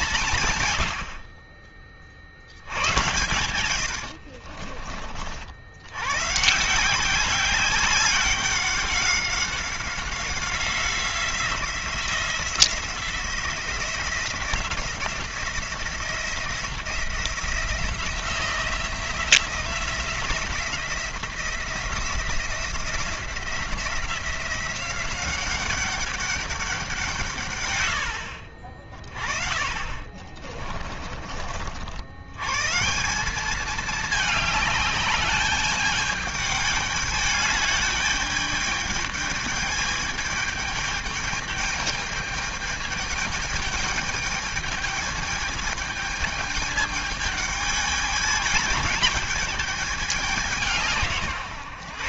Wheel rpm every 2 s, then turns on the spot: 120, 70, 60, 150, 190, 180, 170, 170, 170, 170, 170, 170, 180, 190, 50, 40, 120, 210, 210, 210, 210, 210, 210, 210, 210, 180.
0-2 4-6 30-32